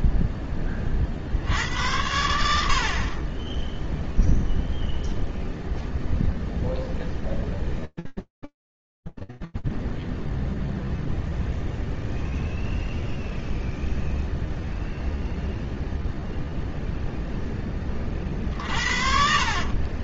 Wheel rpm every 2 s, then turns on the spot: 0, 80, 0, 0, 0, 0, 0, 0, 0, 70.
none